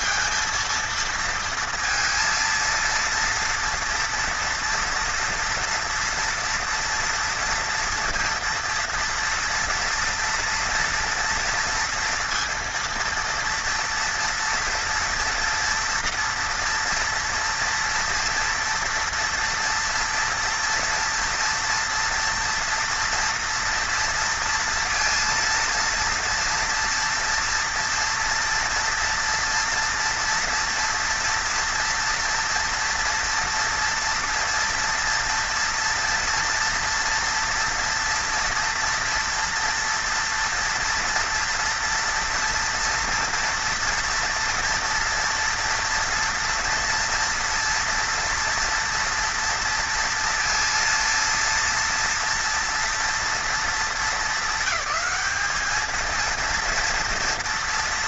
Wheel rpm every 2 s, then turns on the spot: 230, 230, 230, 230, 230, 230, 230, 240, 230, 230, 230, 230, 230, 230, 230, 230, 230, 240, 230, 240, 230, 230, 230, 230, 230, 230, 230, 220, 230.
none